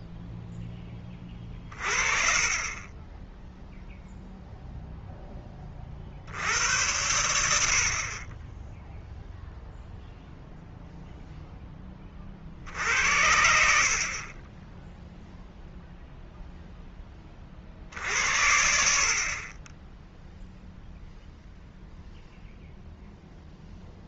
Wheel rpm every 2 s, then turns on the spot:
10, 30, 0, 90, 10, 0, 60, 10, 10, 60, 0, 0.
none